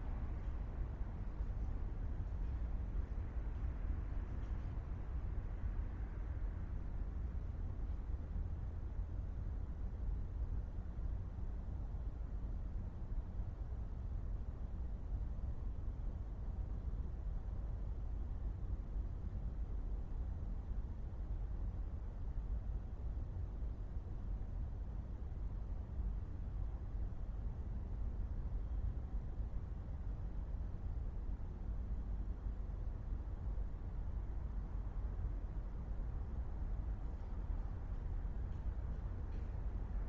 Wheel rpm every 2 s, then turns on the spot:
0, 0, 0, 0, 0, 0, 0, 0, 0, 0, 0, 0, 0, 0, 0, 0, 0, 0, 0, 0.
none